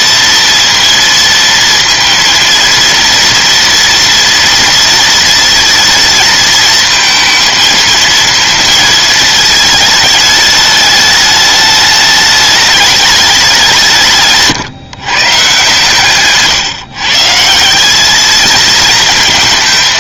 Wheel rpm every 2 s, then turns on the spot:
230, 230, 230, 220, 230, 210, 210, 150, 140, 220.
none